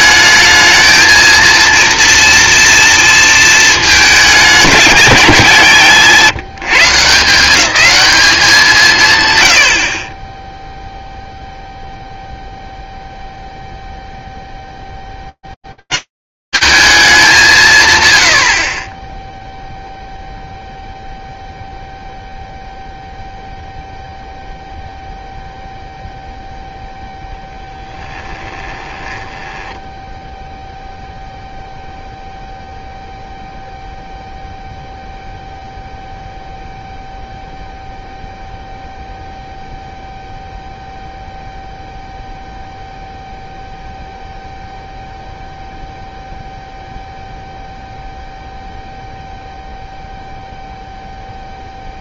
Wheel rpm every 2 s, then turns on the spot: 220, 230, 220, 160, 180, 0, 0, 10, 190, 120, 0, 0, 0, 0, 10, 0, 0, 0, 0, 0, 0, 0, 0, 0, 0, 0.
28-30